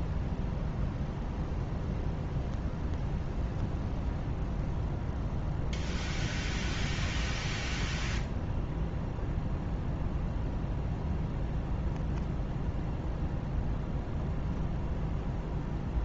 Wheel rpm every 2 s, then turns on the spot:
0, 0, 0, 0, 0, 0, 0, 0.
none